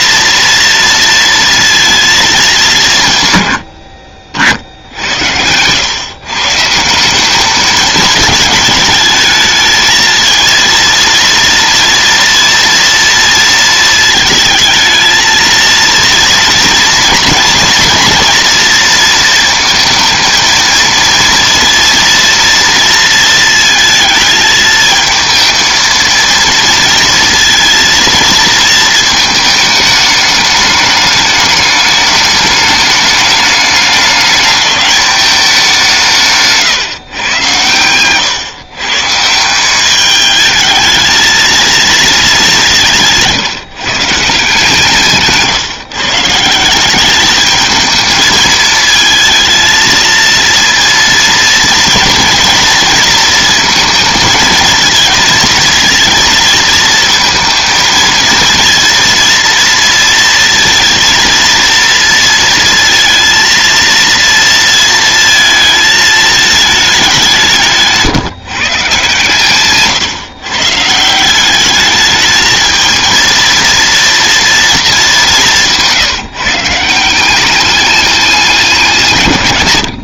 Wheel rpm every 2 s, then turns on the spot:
230, 140, 70, 180, 220, 230, 230, 220, 230, 230, 230, 230, 220, 230, 220, 210, 210, 210, 130, 140, 220, 170, 160, 200, 220, 230, 230, 230, 220, 230, 230, 230, 230, 200, 140, 150, 220, 220, 170, 150.
42-44